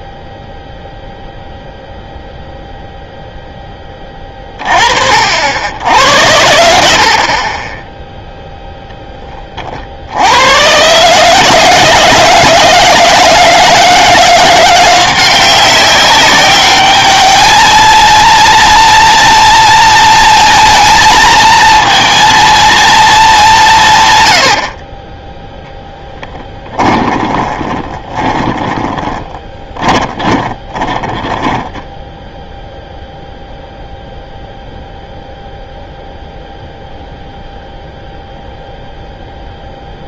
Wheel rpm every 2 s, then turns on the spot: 0, 0, 30, 70, 0, 110, 160, 170, 200, 230, 230, 230, 60, 20, 20, 20, 0, 0, 0, 0.
26-32